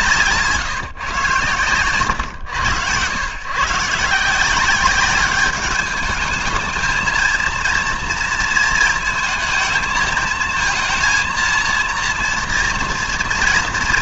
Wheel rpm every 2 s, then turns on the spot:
160, 100, 180, 210, 220, 220, 230.
none